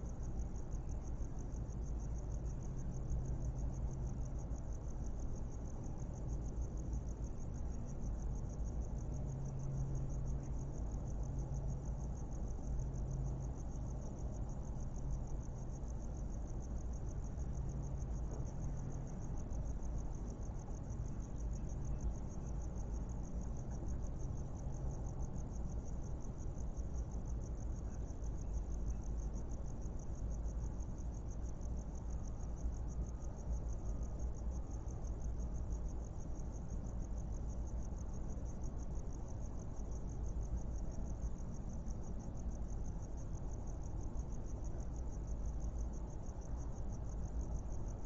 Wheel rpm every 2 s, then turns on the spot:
0, 0, 0, 0, 0, 0, 0, 0, 0, 0, 0, 0, 0, 0, 0, 0, 0, 0, 0, 0, 0, 0, 0, 0.
none